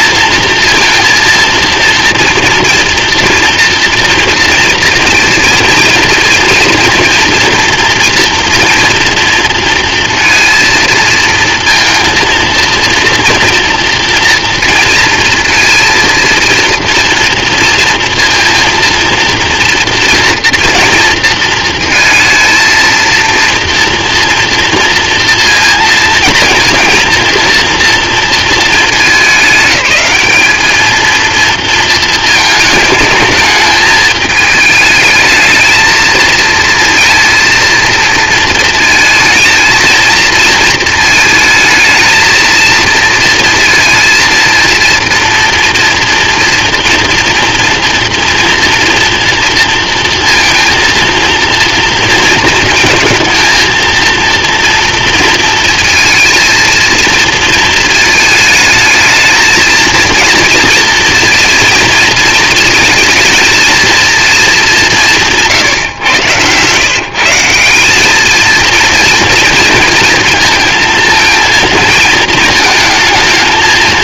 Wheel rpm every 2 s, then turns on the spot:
230, 230, 230, 230, 230, 230, 230, 230, 230, 230, 230, 230, 230, 230, 220, 220, 220, 210, 220, 230, 230, 220, 230, 230, 240, 230, 220, 230, 230, 220, 230, 220, 220, 130, 230, 230, 220.
none